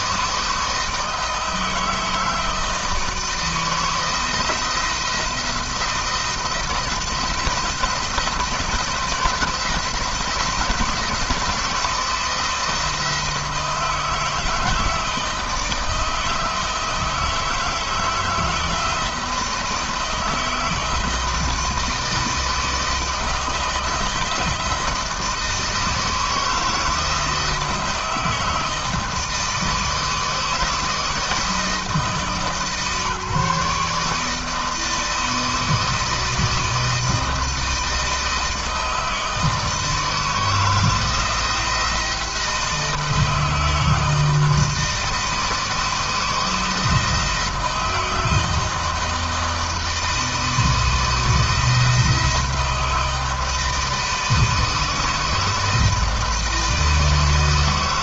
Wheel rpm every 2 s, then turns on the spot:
160, 160, 170, 160, 170, 160, 160, 160, 160, 160, 160, 160, 160, 160, 160, 160, 140, 160, 160, 160, 160, 160, 160, 160, 160, 160, 160, 160, 160.
none